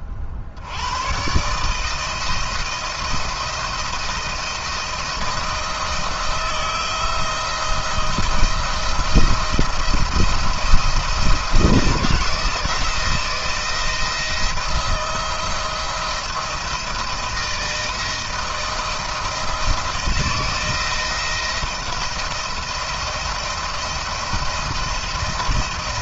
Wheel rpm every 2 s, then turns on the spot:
60, 160, 170, 160, 160, 160, 170, 170, 160, 170, 170, 170, 170.
none